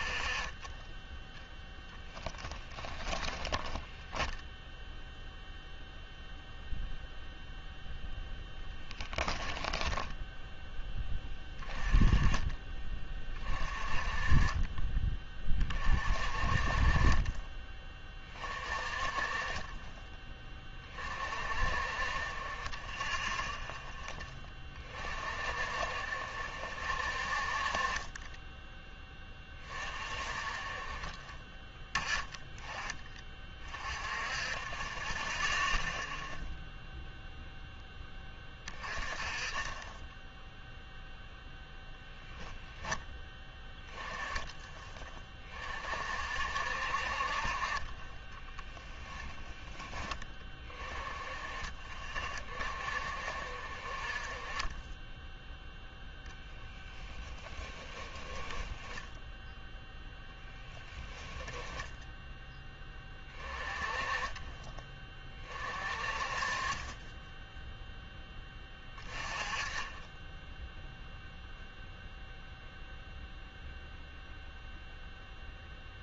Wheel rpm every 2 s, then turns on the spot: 20, 10, 0, 0, 10, 10, 20, 30, 40, 30, 20, 20, 30, 50, 10, 30, 20, 20, 0, 20, 0, 0, 10, 60, 20, 20, 30, 20, 10, 10, 10, 10, 20, 30, 10, 0, 0, 0.
2-4 8-10 48-50 58-62